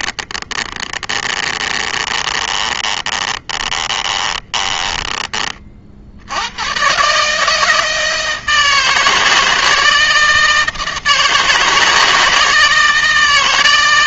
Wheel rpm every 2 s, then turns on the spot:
20, 20, 10, 130, 160, 160, 160.
0-4